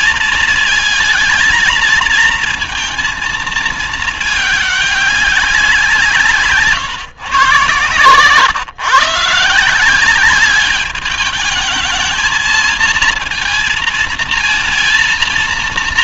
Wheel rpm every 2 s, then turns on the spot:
230, 230, 210, 150, 130, 200, 220, 230.
none